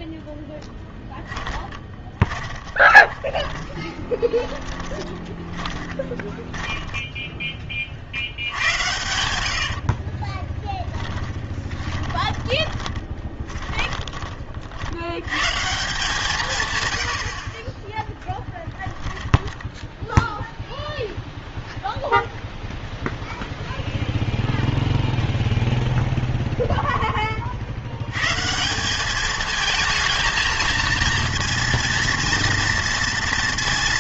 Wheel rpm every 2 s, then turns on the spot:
0, 20, 20, 10, 80, 10, 20, 50, 130, 10, 0, 0, 10, 0, 160, 230, 230.
2-6 10-14 18-20